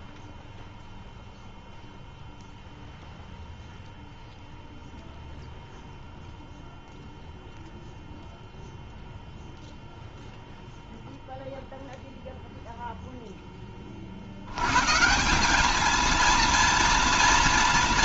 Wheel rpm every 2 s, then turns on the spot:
10, 0, 0, 0, 0, 0, 0, 80, 230.
none